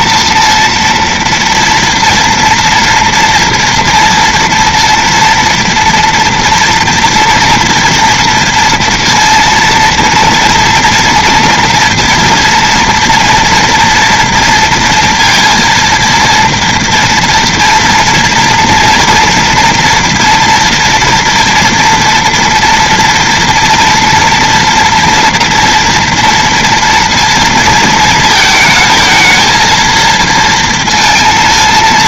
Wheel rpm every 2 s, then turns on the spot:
230, 230, 230, 230, 230, 230, 230, 230, 230, 230, 230, 230, 230, 230, 220, 230.
none